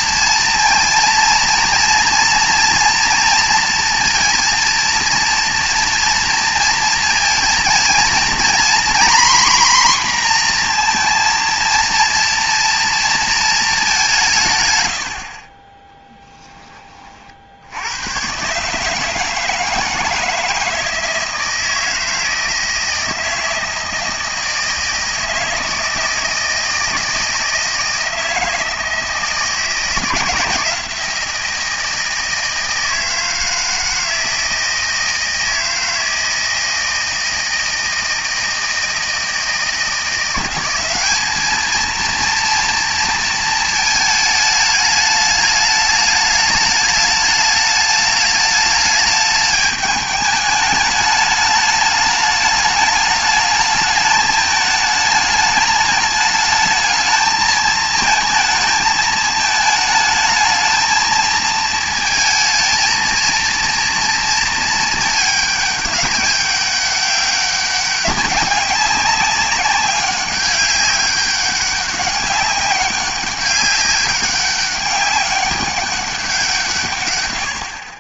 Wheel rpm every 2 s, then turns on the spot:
230, 240, 230, 230, 240, 240, 230, 110, 20, 140, 160, 160, 160, 160, 160, 160, 160, 160, 160, 160, 190, 230, 210, 210, 210, 210, 210, 210, 220, 220, 220, 230, 220, 200, 200, 200, 200, 200, 140.
none